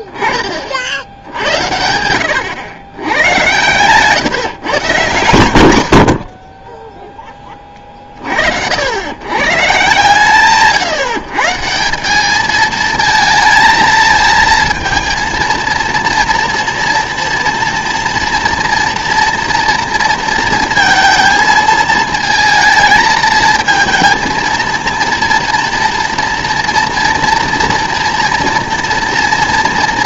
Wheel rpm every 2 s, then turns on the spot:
40, 100, 130, 30, 70, 150, 220, 220, 230, 230, 230, 220, 230, 230, 230.
none